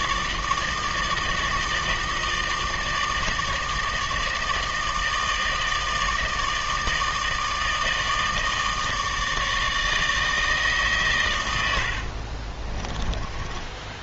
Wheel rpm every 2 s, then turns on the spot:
160, 160, 160, 160, 160, 150, 30.
12-14